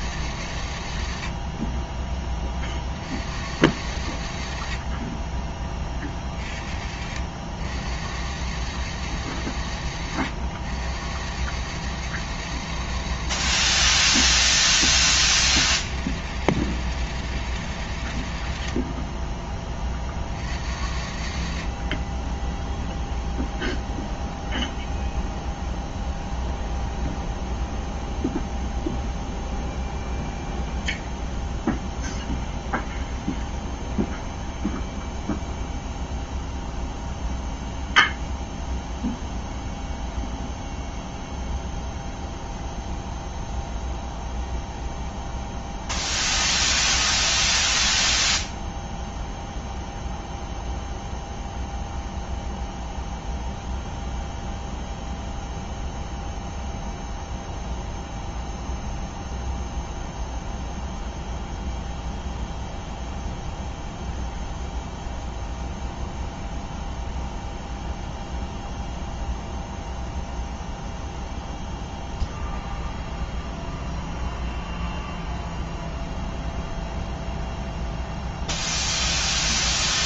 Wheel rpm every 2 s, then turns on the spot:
90, 30, 60, 40, 100, 80, 100, 30, 110, 60, 50, 10, 0, 0, 0, 0, 0, 0, 0, 0, 0, 0, 0, 0, 0, 0, 0, 0, 0, 0, 0, 0, 0, 0, 0, 0, 0, 0, 0, 0.
none